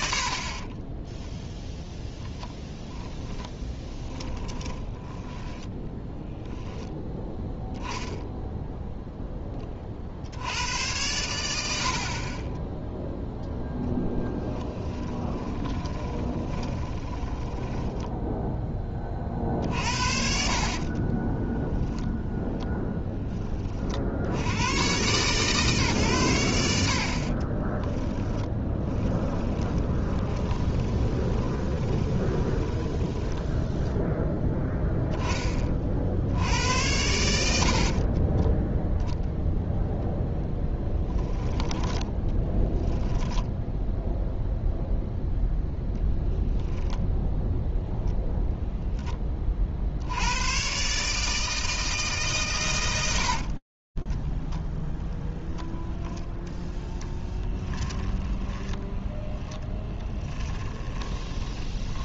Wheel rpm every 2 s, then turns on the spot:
20, 10, 10, 10, 0, 100, 0, 10, 20, 20, 40, 10, 100, 70, 10, 20, 10, 10, 90, 0, 10, 0, 0, 0, 10, 140, 90, 0, 10, 10, 20.
0-2 4-6 14-18 20-22 28-34 40-42 56-58 60-62